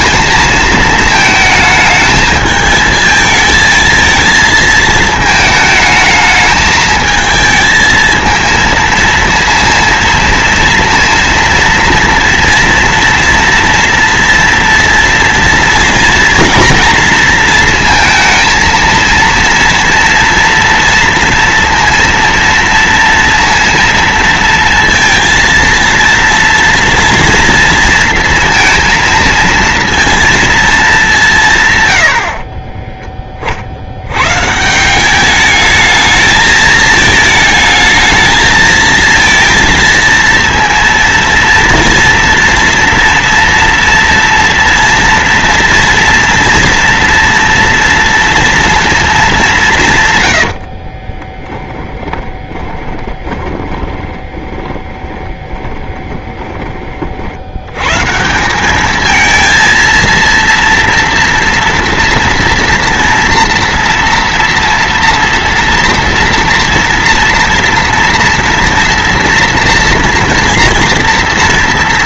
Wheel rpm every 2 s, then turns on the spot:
220, 220, 220, 220, 220, 230, 230, 230, 230, 230, 230, 230, 230, 230, 230, 220, 50, 150, 220, 220, 230, 230, 230, 240, 230, 80, 20, 30, 20, 160, 230, 230, 230, 230, 230, 230.
32-34 50-56